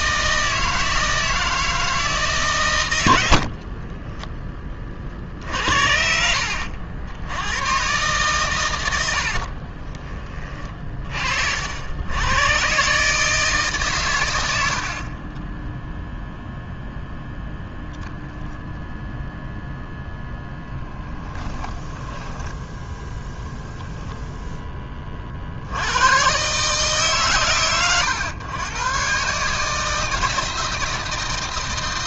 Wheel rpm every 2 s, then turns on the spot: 160, 100, 20, 80, 100, 30, 140, 50, 0, 0, 10, 10, 20, 140, 110, 160.
14-16